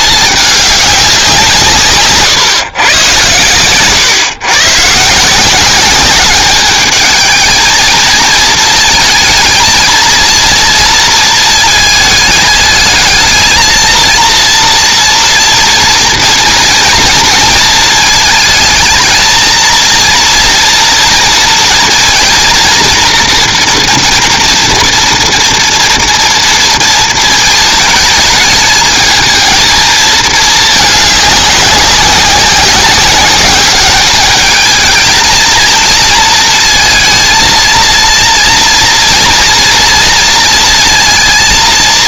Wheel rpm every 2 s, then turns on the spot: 210, 130, 130, 210, 230, 230, 220, 230, 230, 220, 230, 230, 230, 230, 220, 220, 190, 210, 230, 230, 230.
none